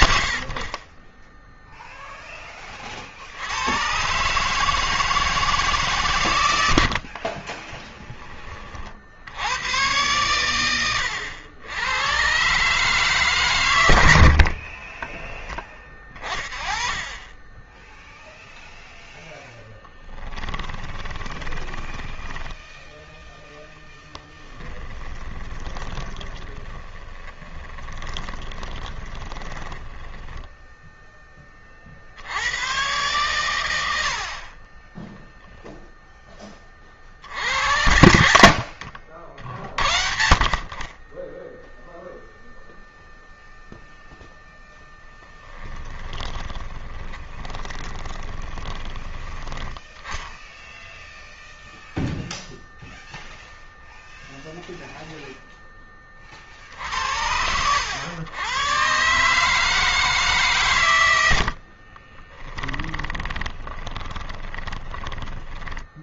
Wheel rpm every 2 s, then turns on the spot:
60, 20, 150, 100, 50, 110, 140, 40, 20, 10, 20, 10, 20, 30, 20, 30, 100, 0, 70, 70, 20, 0, 10, 20, 20, 0, 0, 0, 80, 140, 90, 10, 20.
6-8 14-16 20-22 24-30 44-48 60-64